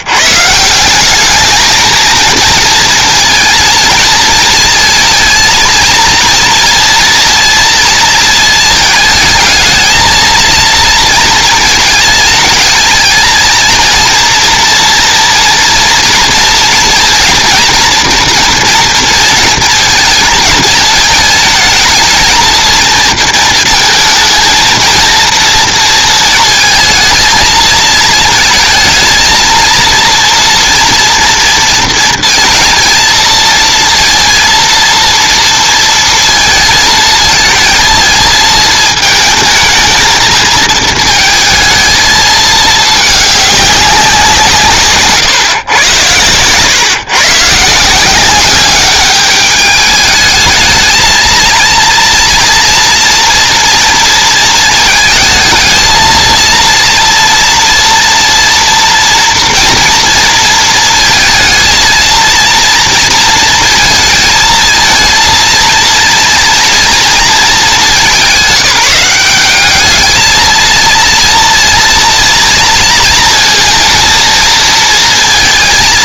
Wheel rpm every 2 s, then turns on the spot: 190, 230, 230, 230, 220, 230, 220, 230, 230, 230, 220, 230, 230, 220, 220, 230, 230, 230, 220, 220, 230, 210, 140, 130, 200, 220, 230, 220, 230, 230, 230, 230, 230, 230, 190, 230, 230, 230.
none